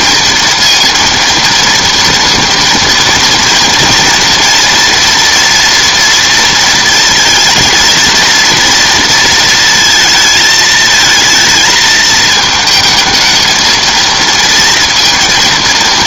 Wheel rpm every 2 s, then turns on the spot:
230, 230, 230, 220, 230, 220, 220, 230.
none